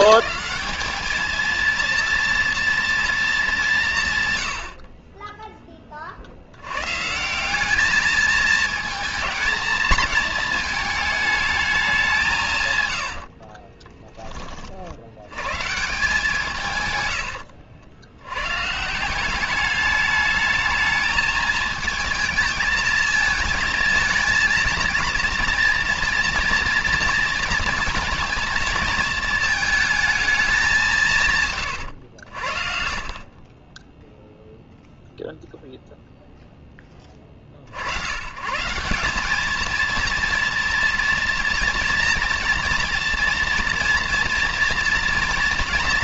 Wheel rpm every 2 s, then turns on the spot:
220, 230, 100, 80, 220, 220, 160, 30, 160, 110, 210, 220, 230, 230, 230, 220, 70, 0, 0, 120, 230, 240, 230.
none